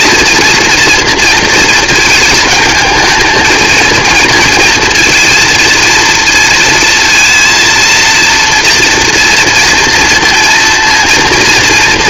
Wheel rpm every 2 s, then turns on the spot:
230, 220, 220, 230, 230, 230.
none